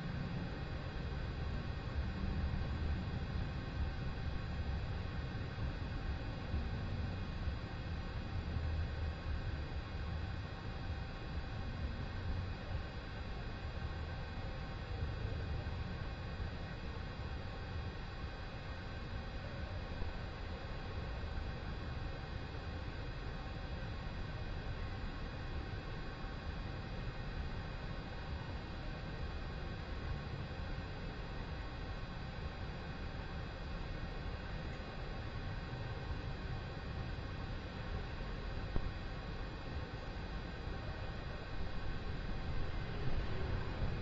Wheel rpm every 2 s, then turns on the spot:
0, 0, 0, 0, 0, 0, 0, 0, 0, 0, 0, 0, 0, 0, 0, 0, 0, 0, 0, 0, 0, 0.
none